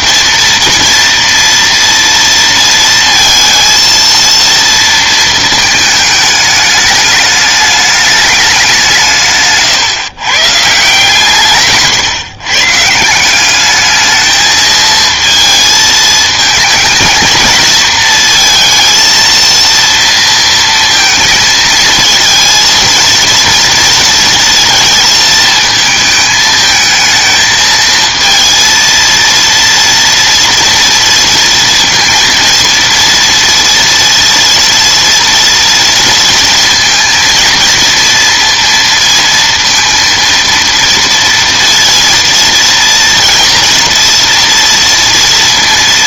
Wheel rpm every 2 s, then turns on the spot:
230, 230, 230, 210, 190, 150, 150, 220, 220, 230, 230, 230, 230, 220, 230, 230, 230, 230, 230, 230, 230, 230, 240.
none